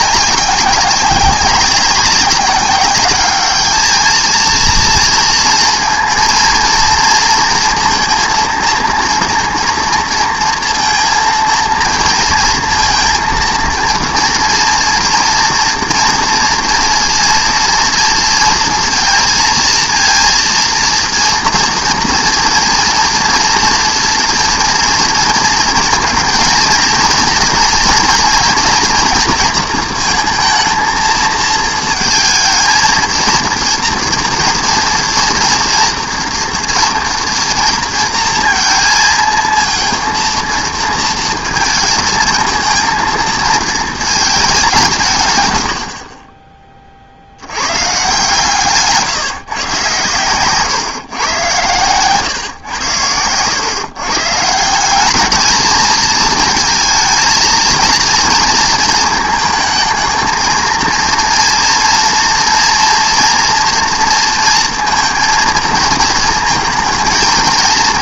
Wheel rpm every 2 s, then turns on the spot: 190, 200, 230, 230, 230, 230, 230, 230, 230, 230, 230, 230, 230, 230, 230, 230, 220, 230, 230, 230, 230, 220, 210, 30, 140, 130, 110, 160, 230, 230, 230, 230, 230, 230.
none